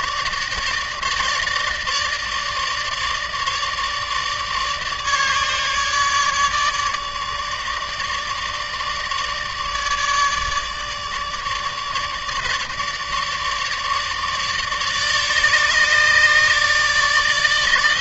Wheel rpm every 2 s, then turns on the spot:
150, 150, 150, 150, 150, 150, 150, 150, 150.
none